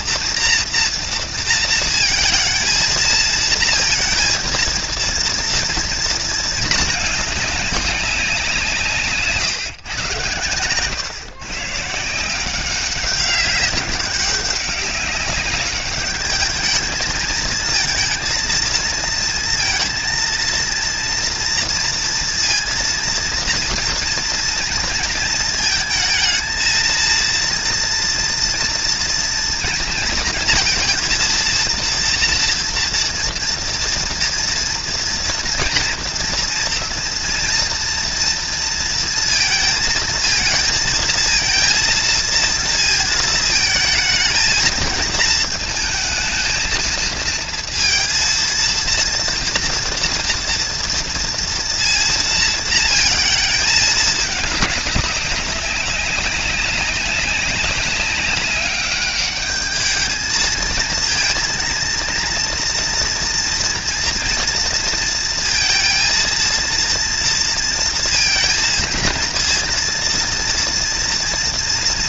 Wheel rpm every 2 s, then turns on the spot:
240, 230, 230, 230, 190, 120, 160, 190, 210, 230, 230, 230, 230, 220, 240, 230, 230, 230, 230, 230, 220, 230, 220, 220, 230, 230, 230, 210, 200, 200, 220, 230, 240, 230, 230, 240.
none